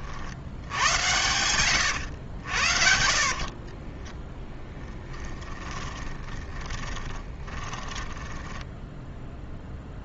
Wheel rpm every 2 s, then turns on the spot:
90, 60, 10, 20, 10.
2-10